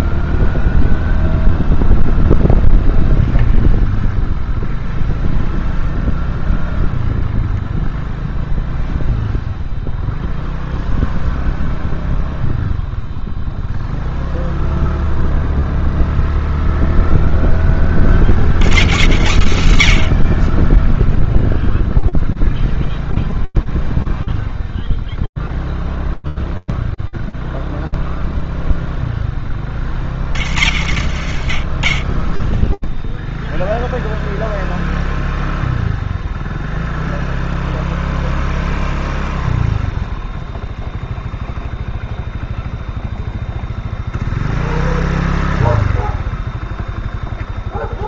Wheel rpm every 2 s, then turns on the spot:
0, 0, 0, 0, 0, 0, 0, 0, 10, 100, 0, 0, 0, 0, 40, 30, 0, 0, 0, 0, 0, 0, 0, 0.
none